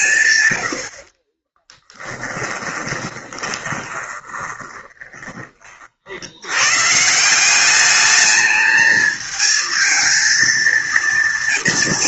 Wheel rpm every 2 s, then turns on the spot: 80, 20, 20, 110, 220, 230.
2-6